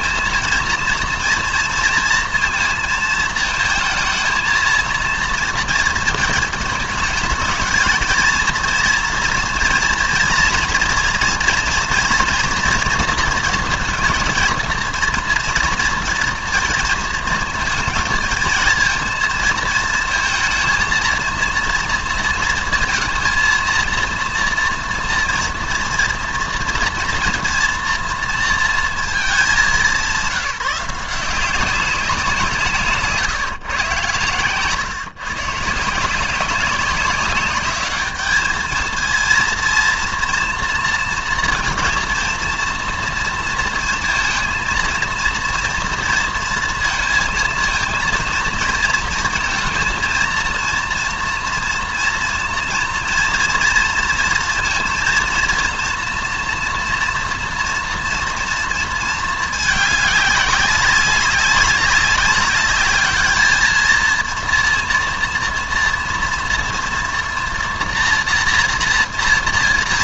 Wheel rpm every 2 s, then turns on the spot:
230, 230, 230, 220, 230, 230, 230, 230, 230, 230, 230, 230, 230, 230, 230, 180, 170, 130, 190, 220, 230, 240, 230, 230, 230, 230, 230, 230, 230, 230, 190, 200, 230, 230, 240.
none